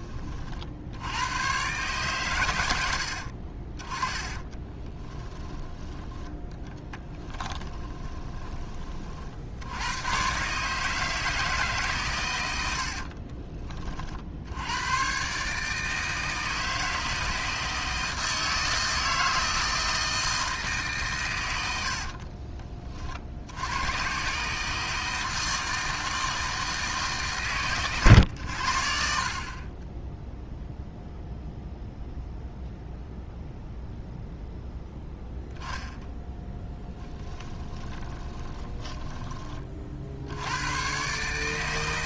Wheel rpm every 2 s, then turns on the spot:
60, 100, 20, 10, 20, 150, 70, 100, 160, 160, 140, 30, 150, 160, 70, 0, 0, 0, 10, 20, 110.
4-8 12-14 36-40